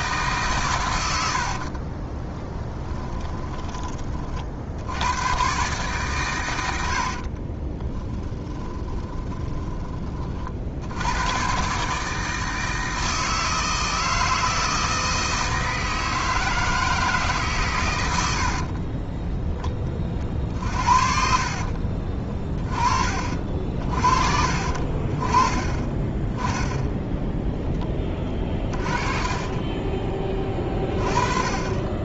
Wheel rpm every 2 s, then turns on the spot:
110, 20, 70, 90, 20, 80, 160, 160, 160, 30, 50, 40, 40, 10, 30, 20.
2-4 6-10 18-22 28-30